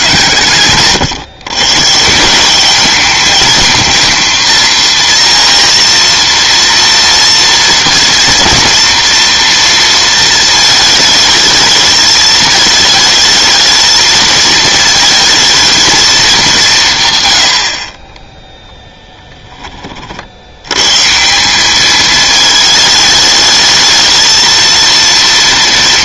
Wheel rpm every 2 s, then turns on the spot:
130, 200, 230, 230, 230, 220, 220, 220, 160, 0, 120, 220, 230.
none